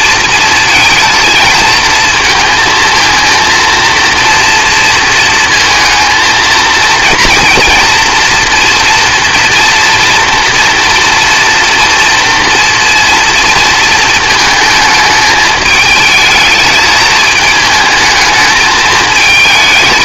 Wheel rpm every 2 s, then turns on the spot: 220, 230, 230, 230, 230, 230, 240, 220, 220, 220.
none